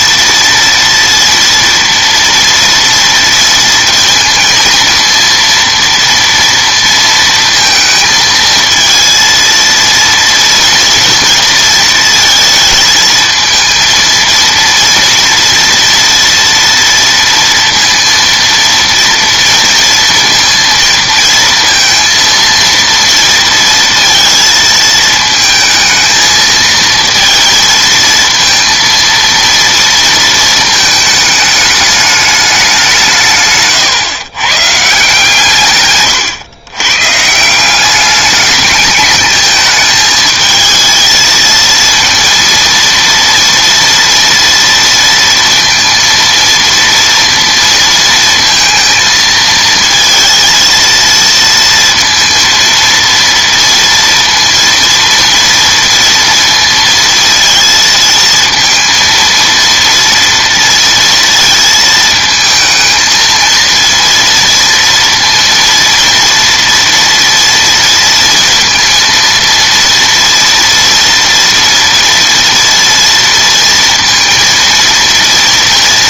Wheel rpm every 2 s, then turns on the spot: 230, 230, 230, 230, 230, 230, 220, 230, 230, 230, 230, 230, 220, 230, 230, 220, 200, 140, 120, 210, 220, 230, 230, 230, 230, 230, 230, 230, 230, 230, 230, 220, 230, 230, 230, 230, 230, 230.
none